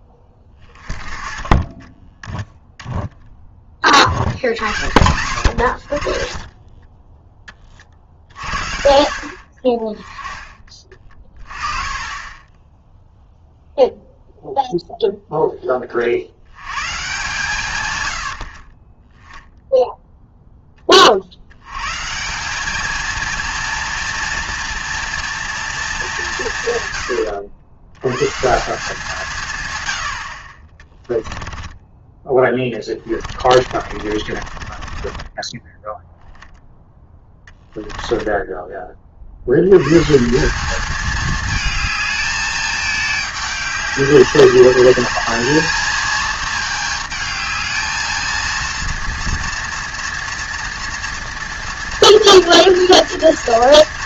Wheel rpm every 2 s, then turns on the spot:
20, 10, 80, 30, 60, 20, 10, 0, 110, 50, 20, 200, 230, 150, 160, 40, 20, 30, 10, 20, 190, 210, 200, 220, 230, 230, 230.
6-8 32-36